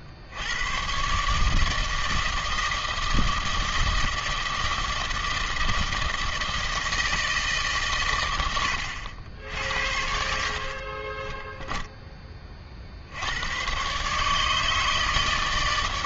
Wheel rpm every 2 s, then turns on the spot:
70, 160, 160, 160, 100, 60, 20, 150.
10-12